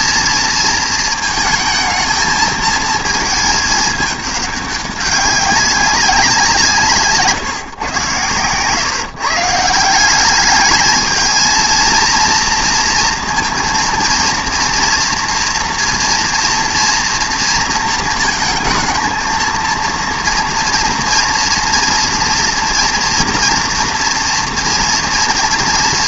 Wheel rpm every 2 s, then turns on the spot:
230, 220, 200, 170, 140, 210, 230, 230, 230, 230, 230, 230, 230.
none